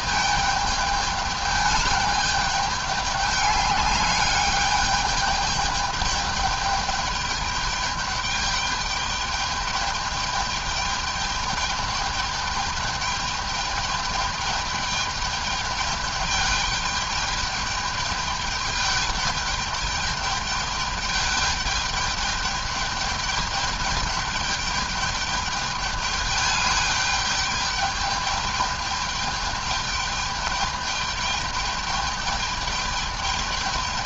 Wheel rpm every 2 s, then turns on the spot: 210, 210, 200, 210, 210, 210, 210, 210, 210, 210, 210, 210, 210, 210, 210, 210, 210.
none